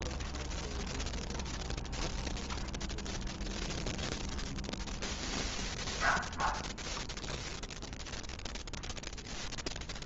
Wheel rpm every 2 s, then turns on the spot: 0, 0, 0, 0, 0.
none